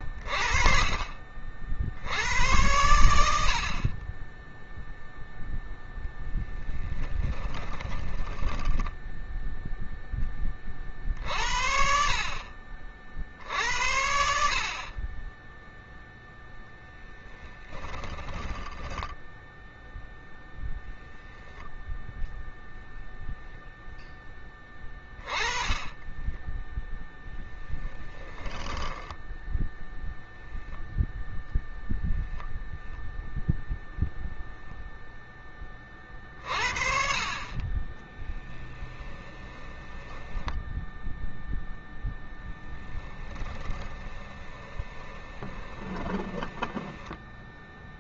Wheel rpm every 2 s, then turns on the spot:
30, 100, 0, 10, 10, 40, 60, 40, 10, 10, 0, 0, 10, 10, 10, 0, 0, 0, 50, 20, 10, 10, 20, 20.
6-8 18-20 38-40 42-46